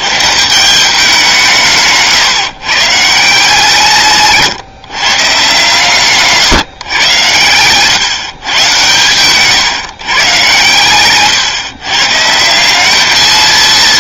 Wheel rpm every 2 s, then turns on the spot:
170, 140, 140, 130, 120, 130, 190.
none